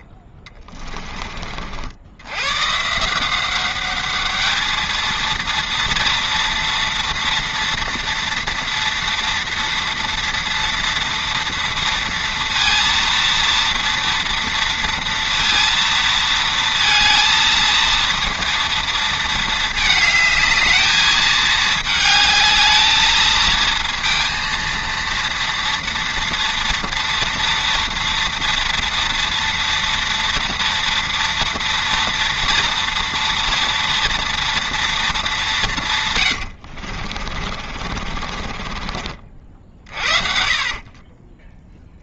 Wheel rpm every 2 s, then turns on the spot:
20, 130, 220, 230, 230, 230, 230, 230, 230, 230, 220, 220, 230, 240, 230, 230, 230, 230, 70, 40, 40.
0-2 36-42